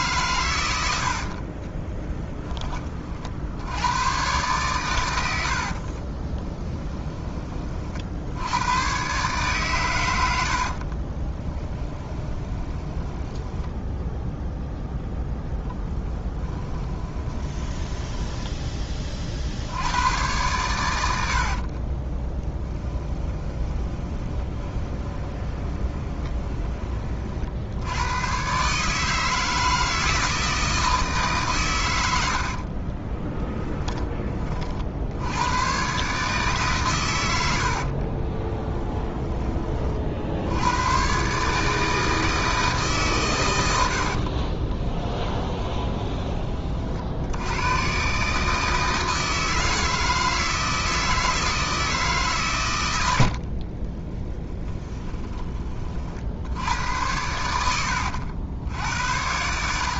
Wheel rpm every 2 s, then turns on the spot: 90, 20, 120, 10, 110, 50, 20, 0, 20, 20, 100, 20, 20, 20, 140, 160, 50, 50, 130, 20, 100, 160, 20, 40, 160, 160, 110, 10, 80, 80.
6-8 10-14 16-18 22-26 32-34 38-40 44-46 54-56